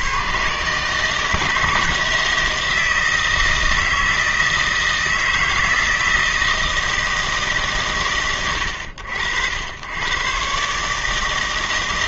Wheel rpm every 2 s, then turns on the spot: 140, 160, 160, 160, 90, 140.
none